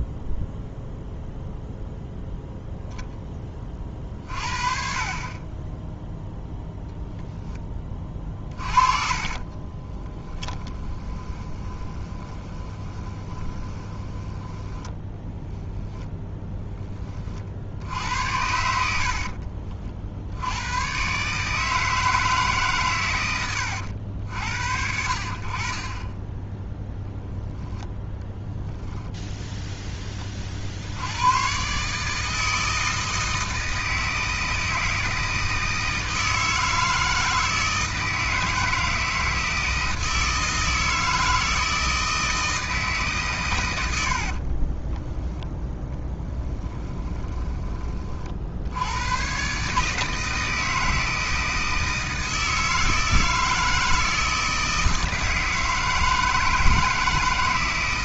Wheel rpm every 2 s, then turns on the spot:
0, 0, 40, 0, 30, 20, 20, 10, 20, 70, 110, 130, 60, 0, 0, 70, 160, 160, 160, 160, 160, 160, 20, 20, 90, 160, 160, 160, 160.
8-14 44-48